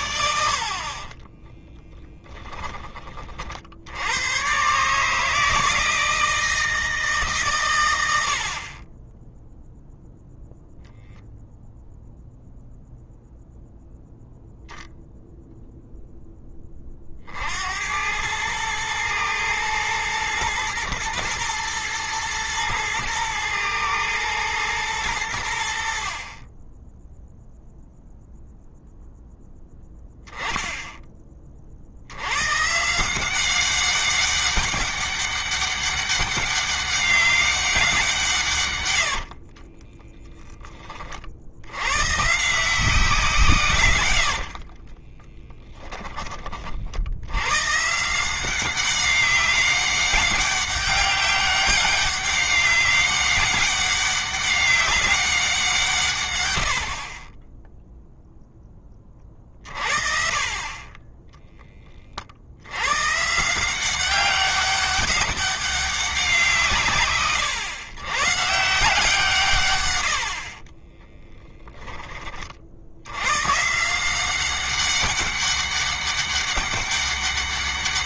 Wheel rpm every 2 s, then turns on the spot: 40, 20, 140, 150, 30, 0, 0, 0, 30, 110, 120, 110, 110, 10, 0, 10, 160, 200, 200, 110, 30, 160, 20, 60, 190, 200, 200, 190, 60, 20, 20, 120, 200, 160, 150, 10, 70, 200, 200.
0-2 38-40 44-46 70-72